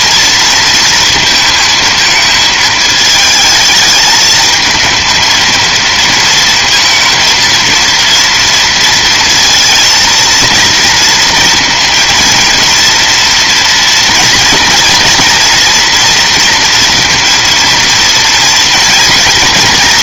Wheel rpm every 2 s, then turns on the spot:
230, 220, 220, 230, 230, 230, 230, 240, 230, 230.
none